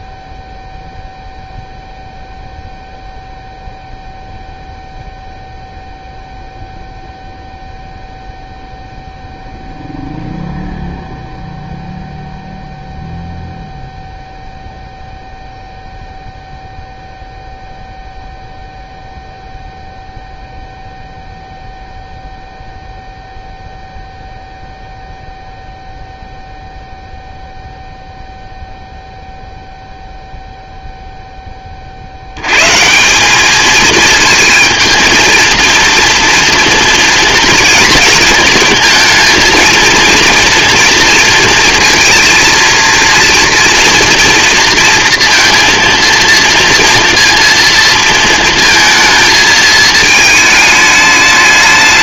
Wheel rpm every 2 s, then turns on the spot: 0, 0, 0, 0, 0, 0, 0, 0, 0, 0, 0, 0, 0, 0, 0, 0, 120, 220, 230, 230, 230, 230, 230, 230, 220, 210.
none